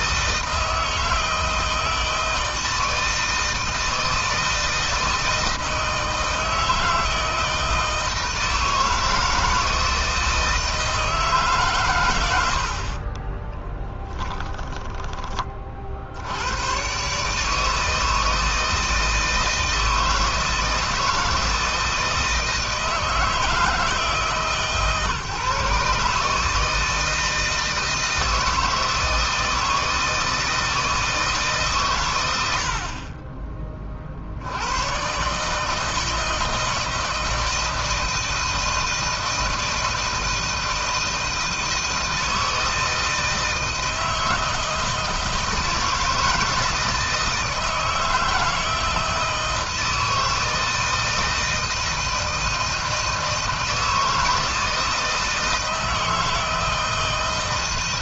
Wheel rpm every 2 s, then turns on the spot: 160, 160, 160, 160, 160, 160, 60, 20, 120, 160, 160, 160, 150, 160, 160, 160, 50, 110, 160, 160, 160, 160, 160, 160, 160, 160, 160, 160, 160.
12-14